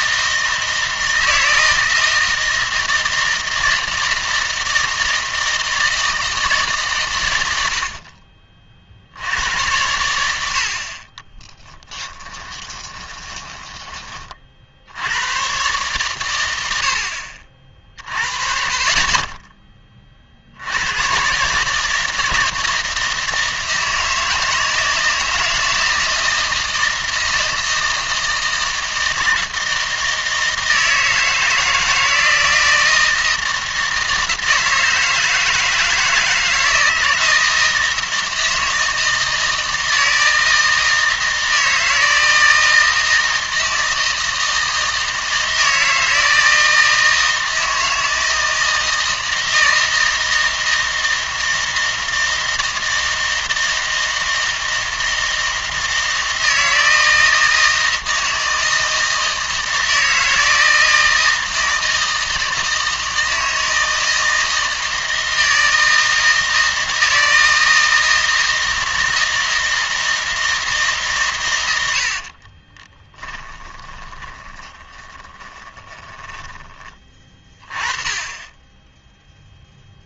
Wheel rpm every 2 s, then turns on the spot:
160, 160, 160, 150, 40, 60, 20, 60, 90, 30, 90, 160, 160, 160, 160, 160, 170, 160, 160, 160, 160, 160, 160, 160, 160, 160, 160, 160, 160, 160, 160, 160, 160, 160, 160, 150, 20, 20, 30, 10.
12-14 72-76